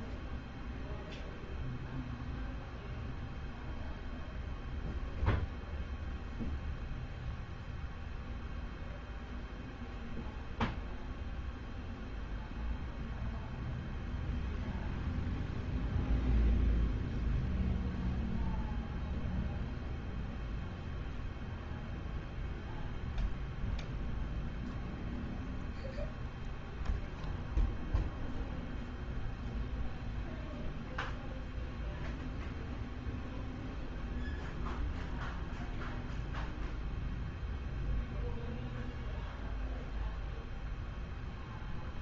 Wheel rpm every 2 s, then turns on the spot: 0, 0, 0, 0, 0, 0, 0, 0, 0, 0, 0, 0, 0, 0, 0, 0, 0, 0, 0, 0, 0.
none